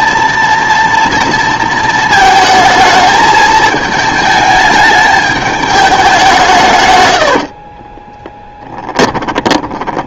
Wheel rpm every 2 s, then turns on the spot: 230, 220, 220, 140, 10.
8-10